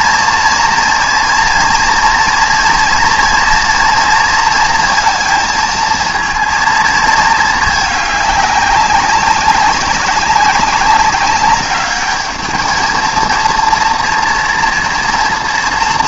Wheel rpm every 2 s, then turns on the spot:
230, 230, 230, 230, 200, 190, 220, 230.
none